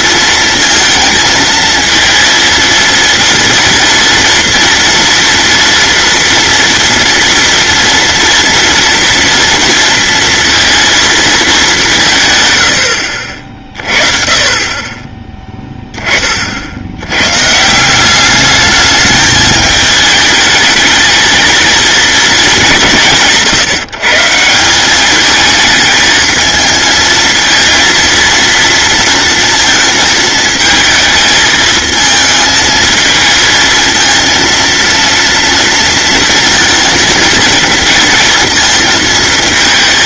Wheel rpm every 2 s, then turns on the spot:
230, 230, 230, 230, 230, 210, 50, 10, 140, 210, 230, 150, 220, 230, 230, 220, 220, 230, 230, 220.
none